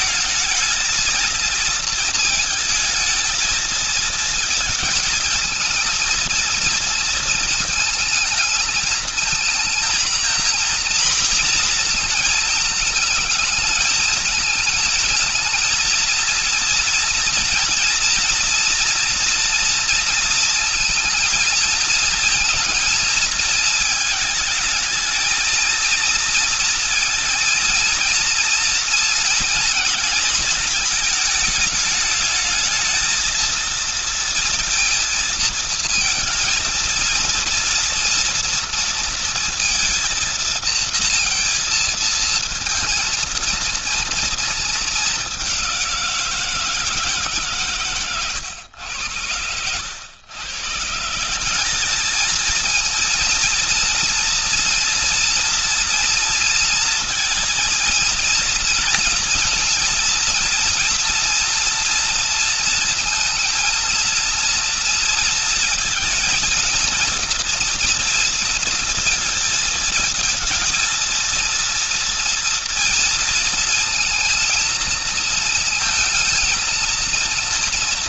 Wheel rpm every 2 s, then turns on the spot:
220, 220, 220, 230, 220, 230, 230, 220, 230, 230, 230, 230, 220, 230, 230, 220, 220, 230, 220, 230, 230, 230, 220, 170, 110, 100, 220, 240, 230, 230, 230, 230, 230, 230, 230, 220, 230, 230, 230.
none